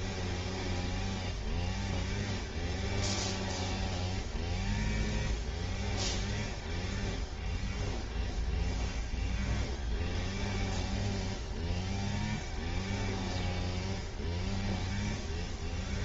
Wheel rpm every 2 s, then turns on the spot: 0, 0, 0, 0, 0, 0, 0, 0.
none